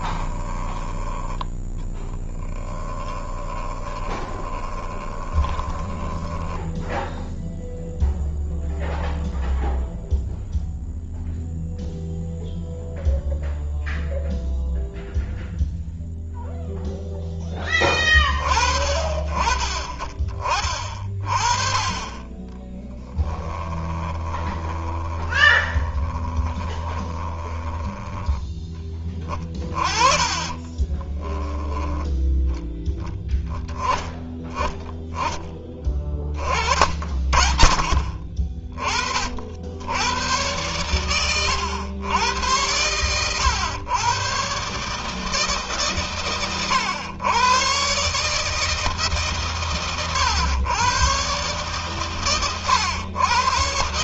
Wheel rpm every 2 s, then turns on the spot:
20, 10, 20, 10, 0, 0, 0, 0, 0, 40, 40, 20, 20, 20, 10, 30, 10, 20, 30, 30, 100, 100, 120, 130, 150, 110, 120.
0-8 22-28 30-32